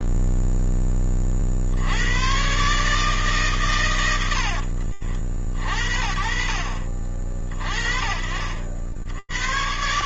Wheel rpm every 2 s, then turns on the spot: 20, 120, 90, 40, 50.
4-6